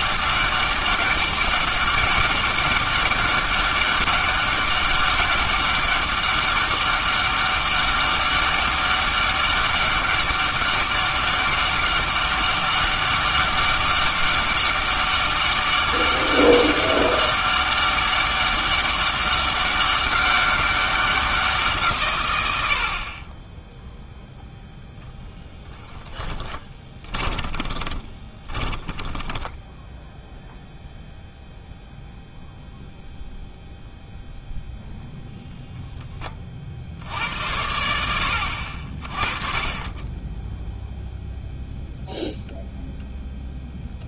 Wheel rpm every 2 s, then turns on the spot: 200, 200, 200, 200, 200, 200, 200, 200, 200, 200, 190, 20, 0, 20, 10, 0, 0, 0, 50, 60, 0, 0.
26-30